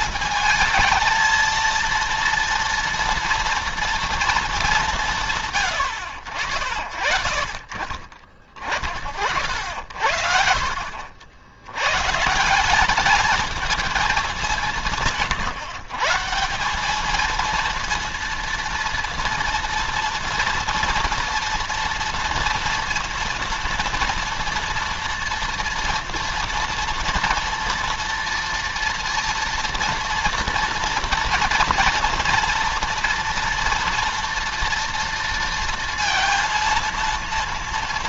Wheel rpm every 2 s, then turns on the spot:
220, 230, 190, 70, 40, 50, 190, 180, 190, 230, 230, 230, 230, 230, 230, 230, 230, 230, 230.
none